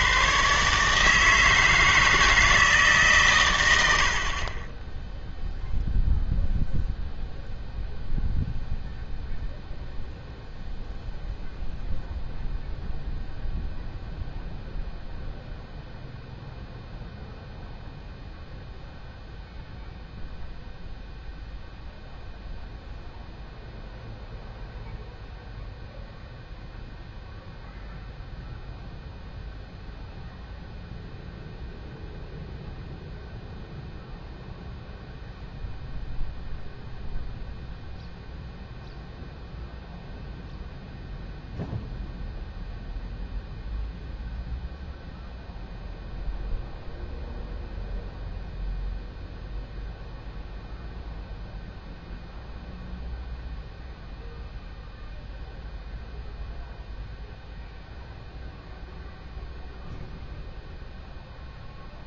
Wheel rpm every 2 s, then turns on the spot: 140, 160, 20, 0, 0, 0, 0, 0, 0, 0, 0, 0, 0, 0, 0, 0, 0, 0, 0, 0, 0, 0, 0, 0, 0, 0, 0, 0, 0, 0, 0.
none